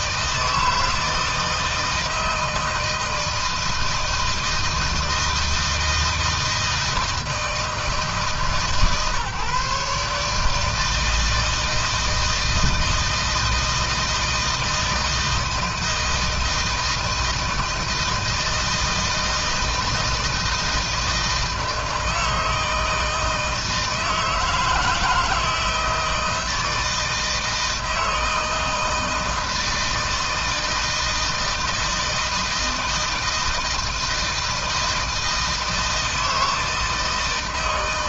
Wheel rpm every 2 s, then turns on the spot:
160, 160, 160, 160, 150, 160, 160, 160, 160, 160, 160, 160, 160, 160, 160, 160, 160, 160, 160.
none